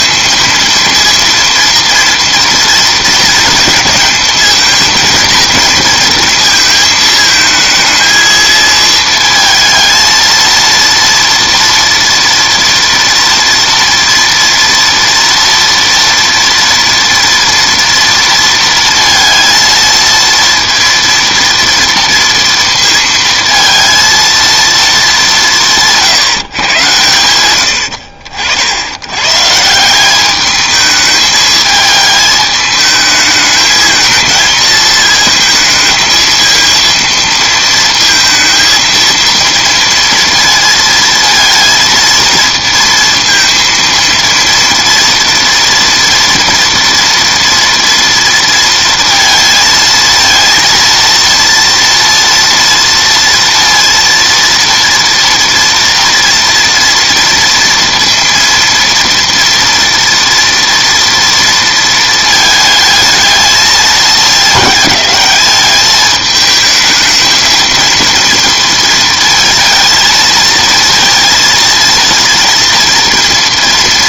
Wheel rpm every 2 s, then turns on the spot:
230, 230, 220, 220, 220, 230, 230, 230, 230, 230, 230, 230, 230, 130, 70, 210, 210, 220, 230, 230, 230, 230, 230, 230, 230, 230, 230, 230, 230, 230, 240, 220, 210, 220, 230, 220, 230.
none